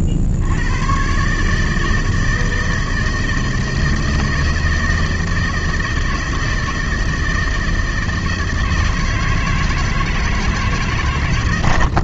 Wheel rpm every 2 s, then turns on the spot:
90, 160, 160, 160, 160, 160.
none